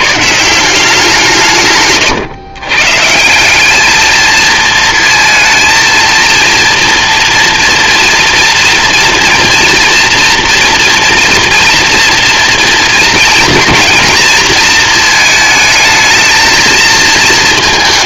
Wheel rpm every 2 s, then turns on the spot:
170, 130, 230, 230, 230, 230, 230, 220, 220.
none